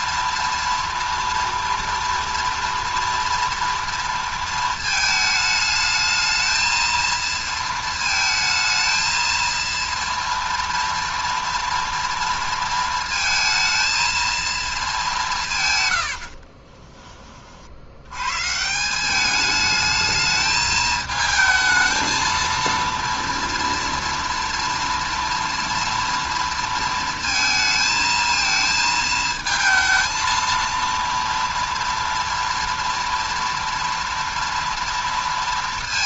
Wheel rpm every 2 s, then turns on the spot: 230, 230, 220, 220, 220, 230, 230, 220, 40, 150, 220, 230, 230, 230, 230, 230, 230, 230.
16-18